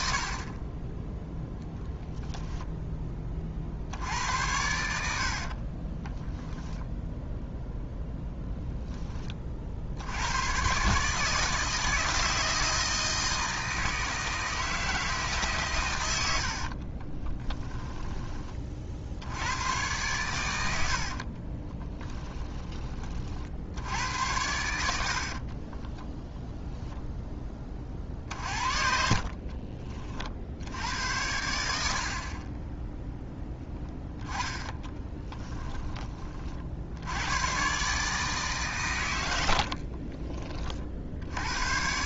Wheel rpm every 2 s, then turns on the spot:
10, 10, 70, 0, 10, 140, 160, 160, 60, 50, 70, 30, 70, 0, 50, 80, 10, 10, 70, 120, 60.
16-18 24-26 28-30 34-36